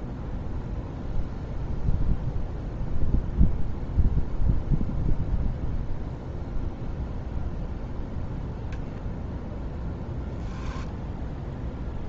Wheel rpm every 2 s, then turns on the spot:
0, 0, 0, 0, 0, 0.
none